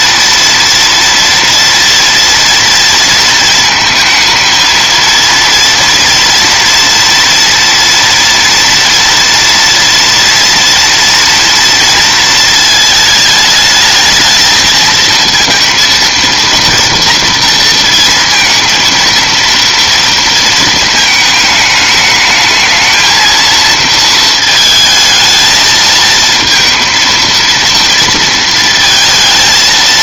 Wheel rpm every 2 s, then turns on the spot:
230, 230, 220, 230, 230, 230, 220, 230, 230, 230, 220, 220, 220, 230, 230.
none